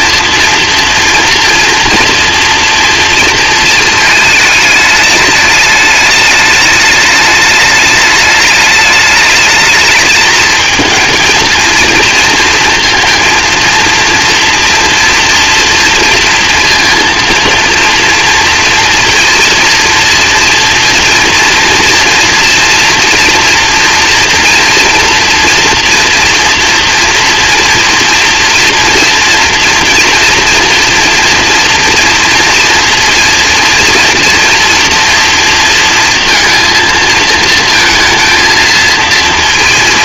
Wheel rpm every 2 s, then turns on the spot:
230, 230, 210, 210, 210, 220, 230, 230, 230, 230, 230, 230, 230, 230, 240, 230, 230, 230, 230, 230.
none